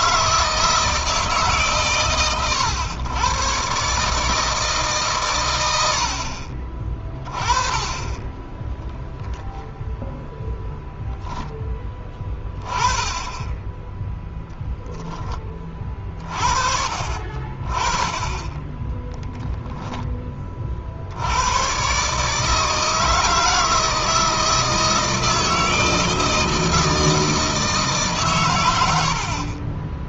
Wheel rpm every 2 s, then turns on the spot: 160, 110, 140, 30, 0, 0, 20, 0, 50, 10, 50, 160, 160, 160, 120.
18-20